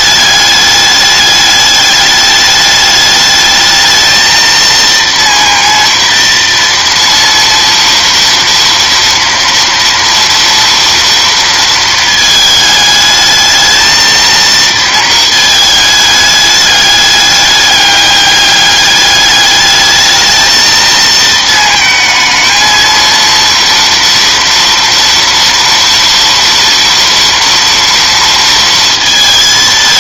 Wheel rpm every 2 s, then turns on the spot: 210, 210, 230, 230, 230, 230, 220, 230, 210, 200, 220, 220, 230, 230, 230.
none